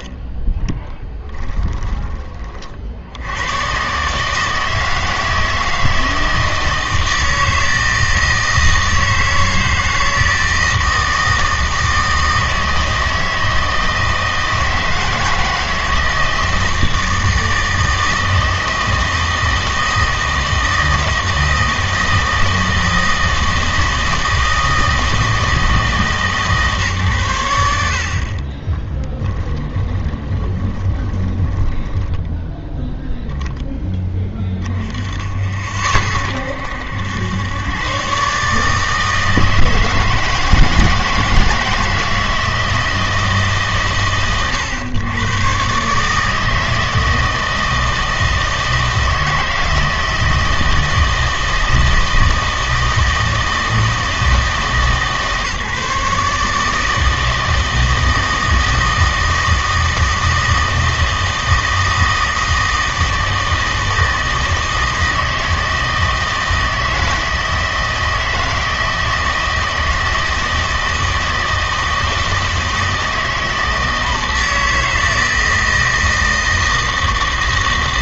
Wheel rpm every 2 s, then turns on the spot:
10, 50, 160, 160, 160, 160, 160, 160, 160, 160, 160, 160, 160, 140, 20, 20, 0, 10, 70, 150, 160, 160, 110, 160, 160, 160, 160, 160, 150, 160, 160, 160, 160, 160, 160, 160, 160, 160, 160.
0-2 28-32